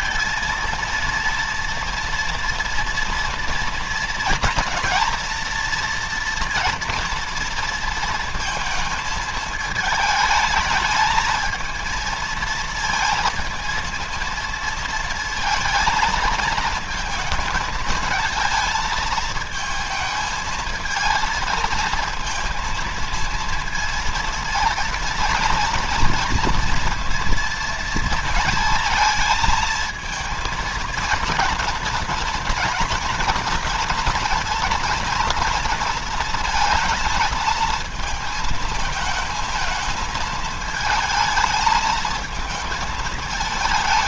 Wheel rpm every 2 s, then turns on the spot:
230, 230, 240, 230, 220, 220, 230, 230, 220, 220, 220, 230, 230, 230, 230, 230, 240, 230, 220, 220, 220, 220.
none